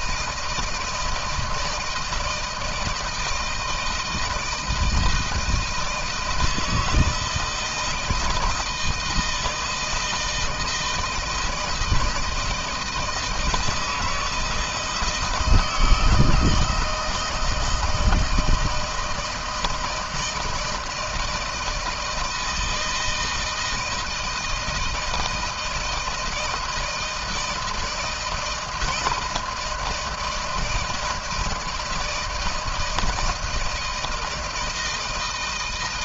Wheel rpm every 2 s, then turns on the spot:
160, 160, 160, 160, 160, 160, 160, 160, 160, 160, 160, 160, 160, 160, 160, 160, 160, 170.
none